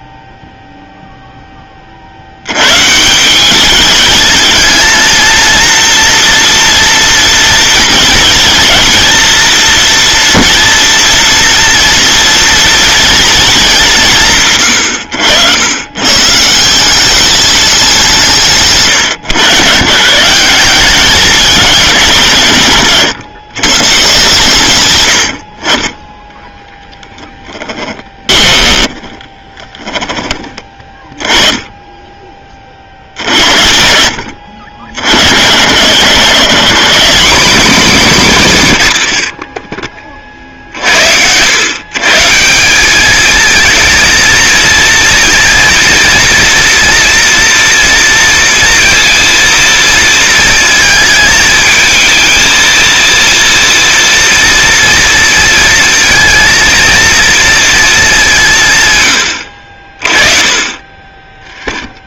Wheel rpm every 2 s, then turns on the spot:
0, 110, 220, 230, 230, 230, 230, 120, 160, 150, 190, 140, 120, 10, 20, 30, 40, 80, 170, 160, 60, 190, 230, 230, 230, 220, 230, 230, 230, 140, 30.
28-30